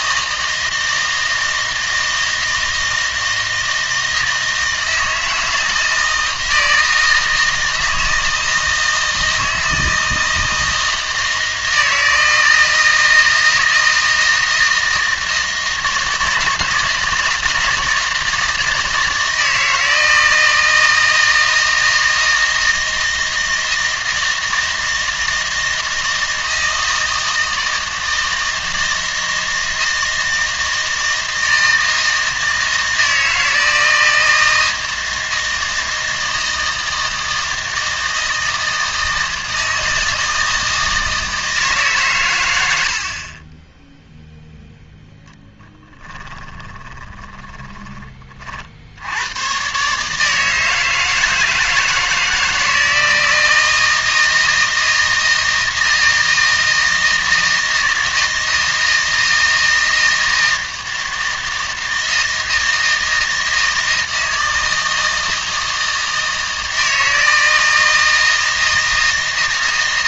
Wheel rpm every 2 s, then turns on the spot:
160, 160, 160, 160, 160, 160, 160, 160, 160, 160, 160, 160, 160, 160, 160, 160, 160, 160, 160, 160, 160, 90, 0, 10, 60, 160, 160, 160, 160, 160, 160, 160, 160, 160, 160.
46-48